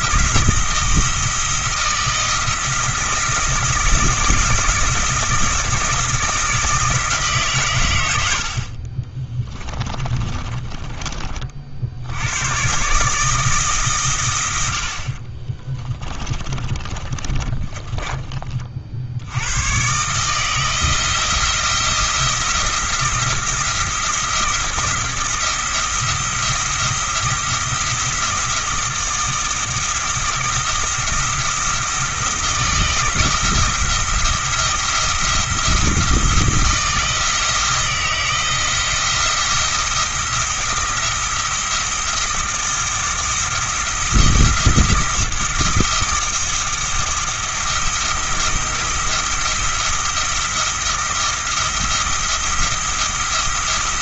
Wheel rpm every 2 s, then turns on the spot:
170, 160, 170, 160, 50, 20, 130, 70, 20, 40, 160, 160, 170, 170, 170, 170, 170, 170, 160, 170, 170, 170, 170, 160, 170, 170, 170.
10-12 16-18